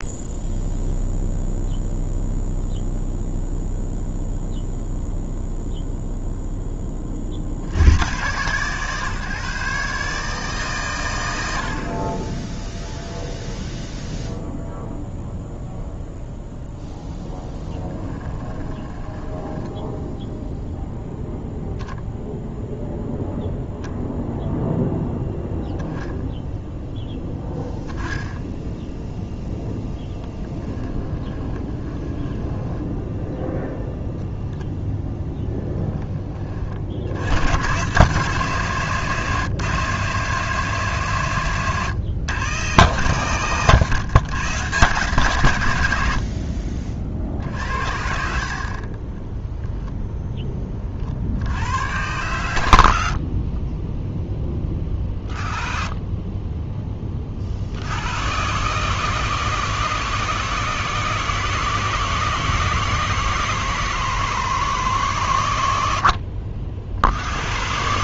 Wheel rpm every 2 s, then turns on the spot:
0, 0, 0, 20, 140, 120, 0, 0, 0, 20, 0, 0, 0, 0, 0, 10, 10, 0, 50, 130, 140, 140, 140, 50, 40, 30, 90, 20, 10, 130, 140, 140, 140, 60.
18-20 30-34 46-50